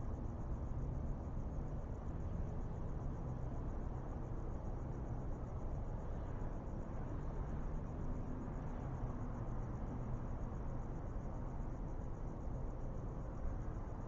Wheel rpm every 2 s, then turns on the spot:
0, 0, 0, 0, 0, 0, 0.
none